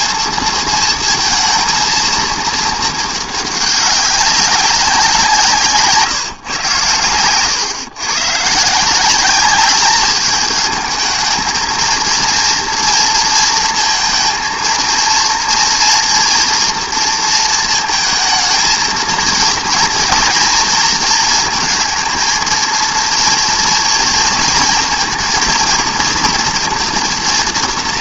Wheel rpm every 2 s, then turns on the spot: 220, 210, 180, 110, 180, 220, 230, 230, 230, 230, 230, 230, 230, 230.
none